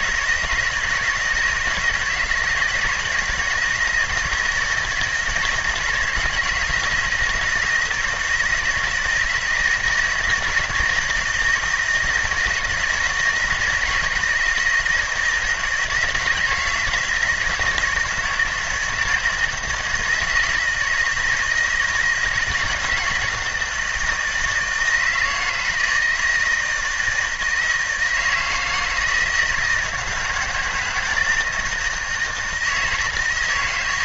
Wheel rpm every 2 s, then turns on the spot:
160, 170, 160, 160, 160, 160, 160, 160, 160, 160, 160, 160, 160, 160, 160, 170, 170.
none